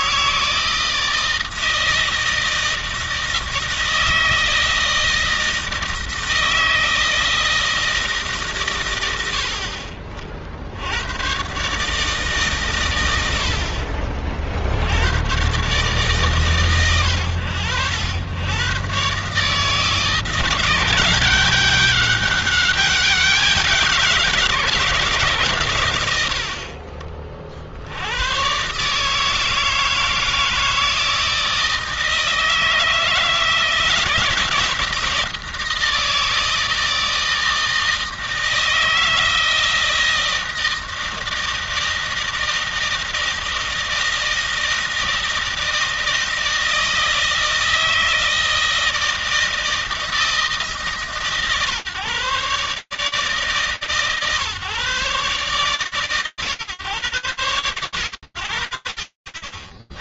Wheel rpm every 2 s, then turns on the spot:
160, 160, 160, 160, 130, 60, 130, 70, 130, 100, 170, 200, 160, 60, 120, 160, 160, 160, 160, 160, 160, 160, 160, 160, 160, 160, 150, 140, 100, 60.
none